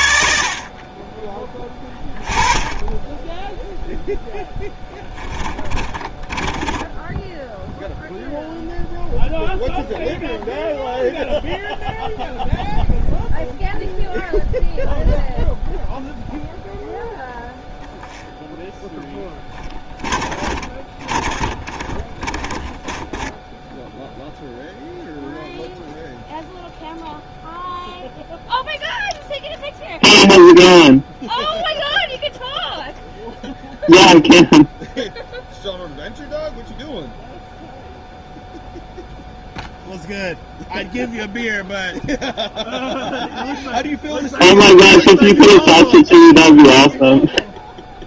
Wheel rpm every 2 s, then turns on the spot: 50, 20, 10, 20, 0, 0, 0, 0, 0, 0, 30, 20, 0, 0, 0, 0, 0, 0, 0, 0, 0, 0, 0, 0.
4-8 20-24